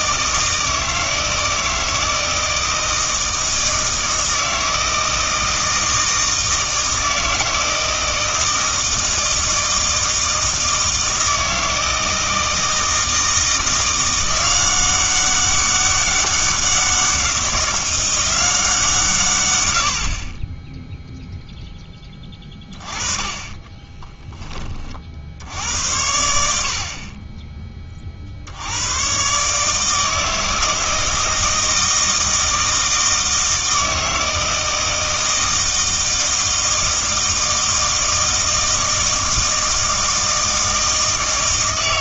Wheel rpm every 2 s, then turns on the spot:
160, 160, 160, 160, 160, 160, 160, 180, 190, 170, 10, 20, 30, 50, 90, 160, 160, 160, 160, 160, 160.
22-24